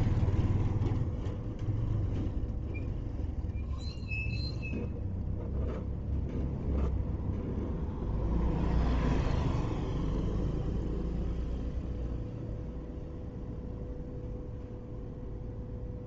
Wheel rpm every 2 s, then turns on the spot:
0, 0, 0, 0, 0, 0, 0, 0.
none